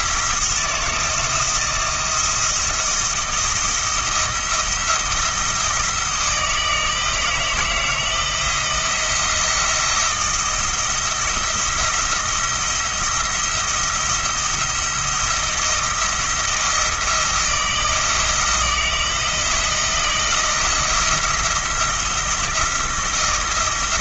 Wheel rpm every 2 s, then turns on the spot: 160, 170, 170, 160, 170, 170, 170, 170, 170, 170, 170, 170.
none